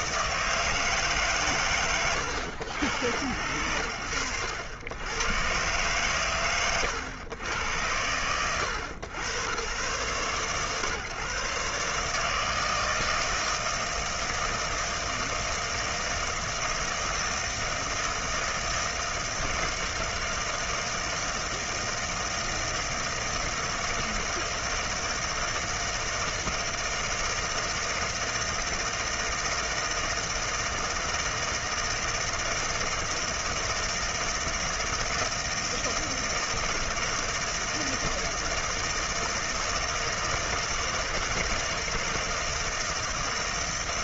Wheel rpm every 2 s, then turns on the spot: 110, 80, 120, 80, 110, 140, 160, 160, 160, 160, 160, 160, 160, 160, 160, 160, 160, 160, 160, 160, 160, 160.
none